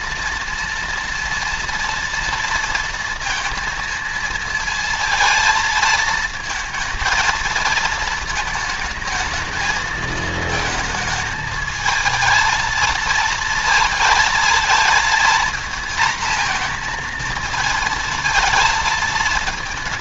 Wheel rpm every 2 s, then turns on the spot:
230, 230, 230, 230, 220, 220, 230, 230, 230, 220.
none